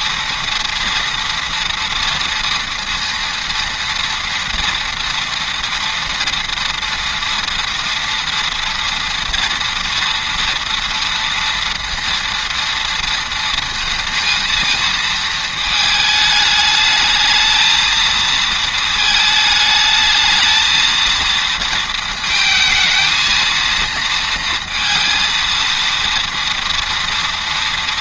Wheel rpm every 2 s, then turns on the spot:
230, 230, 230, 230, 240, 230, 230, 230, 220, 220, 220, 220, 230, 230.
none